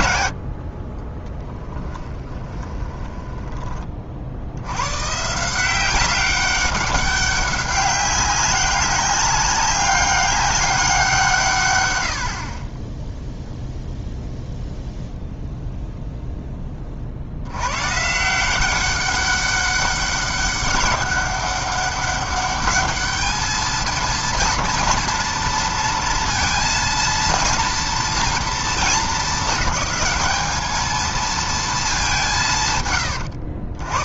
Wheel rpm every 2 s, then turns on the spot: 20, 20, 120, 200, 200, 180, 10, 0, 40, 190, 200, 210, 230, 230, 220, 220, 110.
2-4